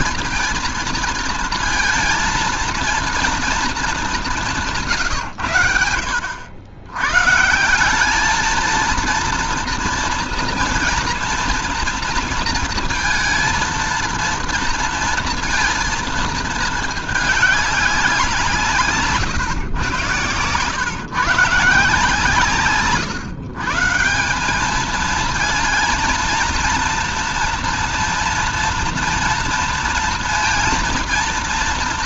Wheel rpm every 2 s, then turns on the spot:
230, 230, 170, 80, 220, 230, 230, 230, 220, 170, 120, 150, 200, 230, 230, 230.
none